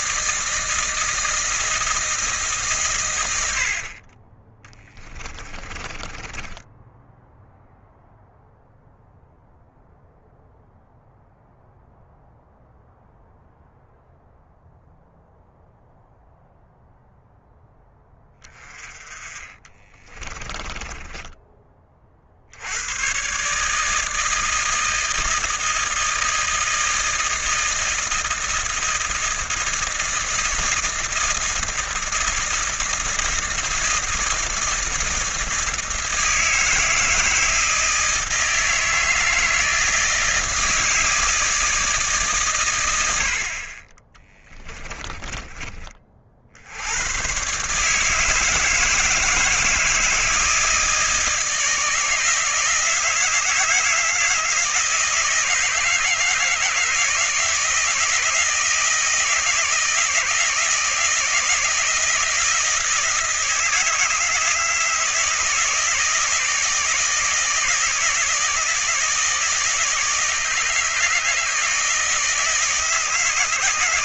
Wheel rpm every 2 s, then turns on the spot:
160, 90, 20, 0, 0, 0, 0, 0, 0, 20, 20, 90, 160, 160, 160, 160, 160, 160, 160, 160, 160, 100, 20, 90, 160, 160, 160, 160, 160, 160, 160, 160, 160, 160, 160, 160, 160.
4-6 18-22 44-46